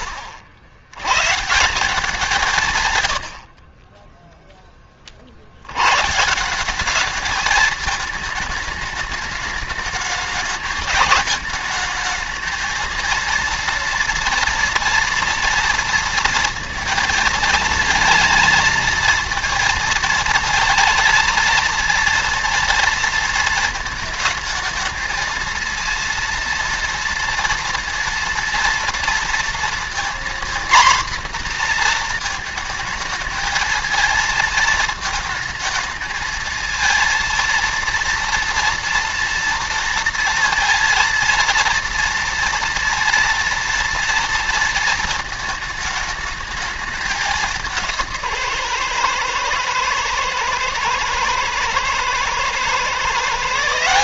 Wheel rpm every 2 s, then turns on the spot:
90, 150, 10, 180, 220, 220, 230, 230, 230, 220, 230, 230, 220, 230, 230, 240, 220, 220, 220, 230, 230, 230, 230, 210, 130, 110, 120.
none